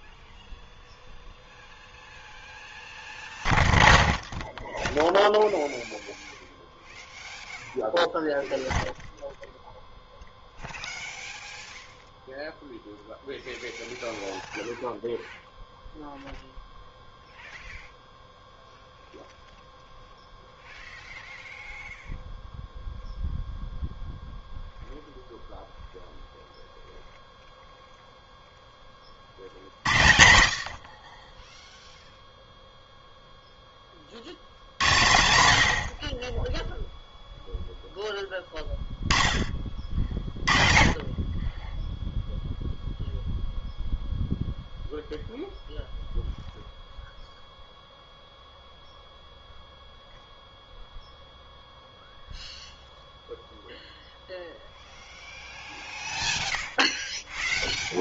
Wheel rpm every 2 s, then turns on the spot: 0, 0, 0, 0, 0, 0, 0, 0, 0, 0, 0, 0, 0, 0, 10, 70, 0, 90, 10, 10, 30, 0, 0, 0, 0, 0, 0, 0, 0.
none